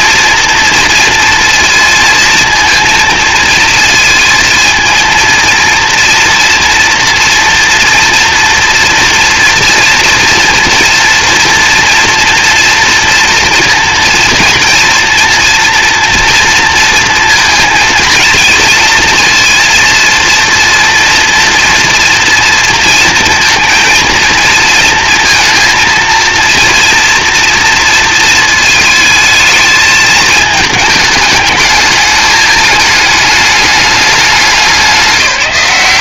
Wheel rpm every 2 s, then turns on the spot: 230, 230, 230, 230, 230, 240, 230, 230, 230, 230, 230, 230, 230, 230, 220, 210, 210, 190.
none